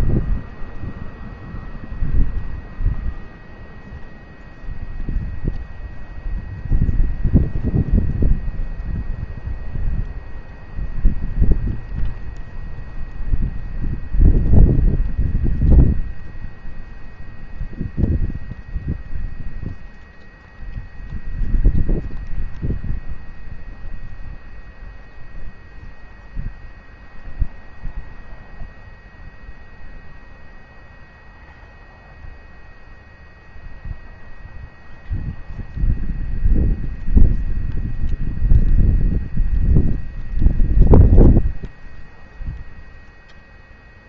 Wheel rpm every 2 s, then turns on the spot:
0, 0, 0, 0, 0, 0, 0, 0, 0, 0, 0, 0, 0, 0, 0, 0, 0, 0, 0, 0, 0, 0.
none